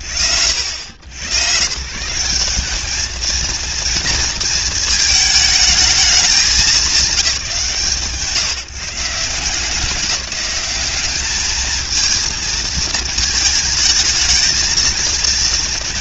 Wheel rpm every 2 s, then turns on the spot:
100, 220, 220, 170, 170, 200, 220, 230.
none